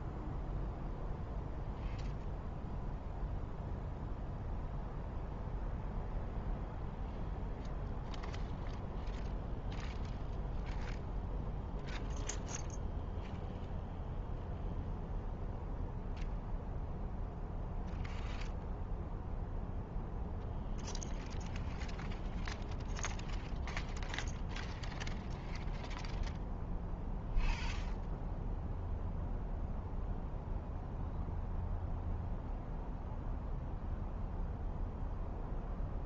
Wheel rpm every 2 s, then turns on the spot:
0, 0, 0, 0, 0, 0, 0, 0, 0, 0, 0, 0, 0, 0, 0, 0, 0, 0.
none